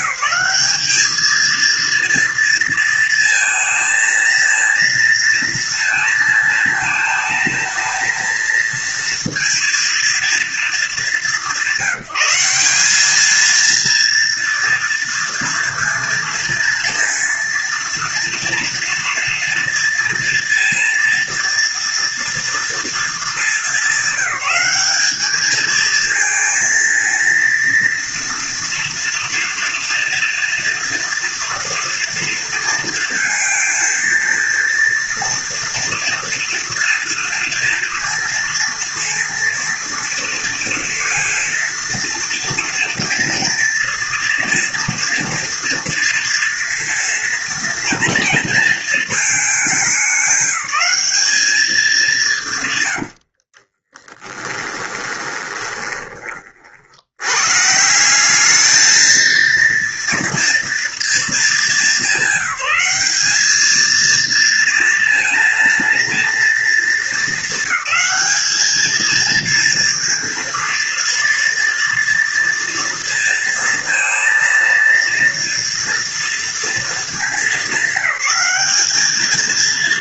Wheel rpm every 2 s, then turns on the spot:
200, 230, 230, 220, 230, 230, 180, 230, 230, 230, 230, 240, 210, 230, 230, 230, 230, 230, 240, 230, 230, 230, 230, 230, 230, 210, 160, 10, 30, 200, 230, 200, 230, 230, 210, 230, 230, 230, 230, 210.
54-56